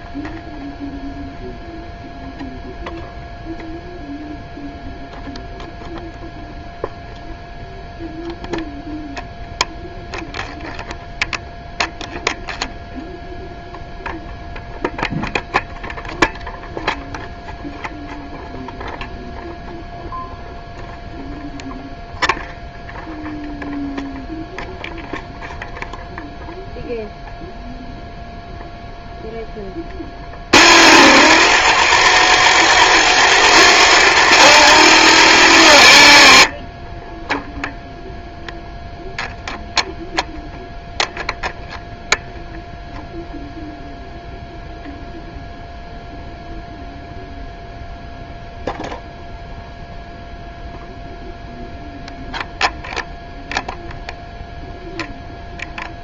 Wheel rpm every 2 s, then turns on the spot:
0, 0, 0, 0, 0, 0, 0, 0, 0, 0, 0, 0, 0, 0, 0, 60, 90, 80, 20, 0, 0, 0, 0, 0, 0, 0, 0, 0.
none